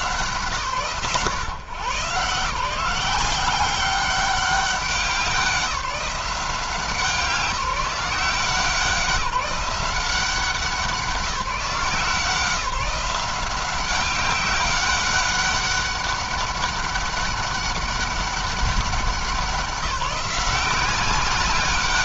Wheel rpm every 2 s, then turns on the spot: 130, 170, 190, 170, 180, 180, 180, 200, 200, 200, 180.
none